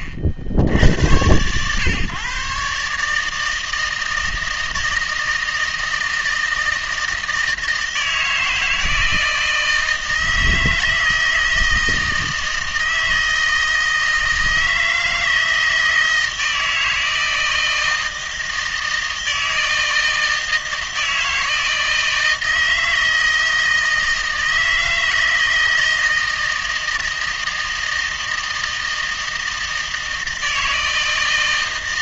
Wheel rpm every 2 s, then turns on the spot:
70, 140, 160, 160, 160, 160, 160, 160, 160, 160, 160, 160, 160, 160, 160, 160.
none